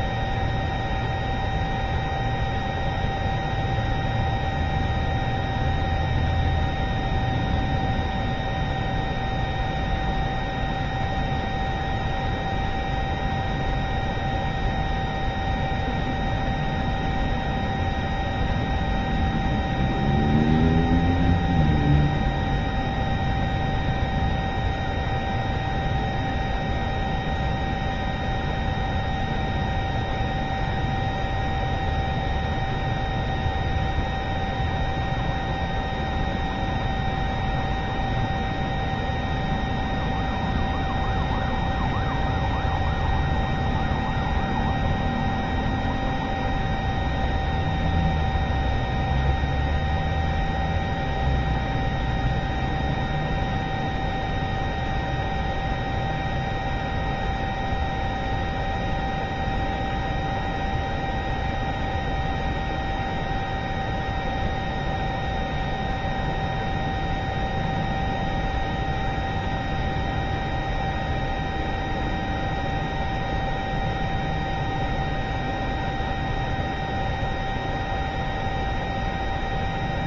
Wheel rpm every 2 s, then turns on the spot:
0, 0, 0, 0, 0, 0, 0, 0, 0, 0, 0, 0, 0, 0, 0, 0, 0, 0, 0, 0, 0, 0, 0, 0, 0, 0, 0, 0, 0, 0, 0, 0, 0, 0, 0, 0, 0, 0, 0, 0.
none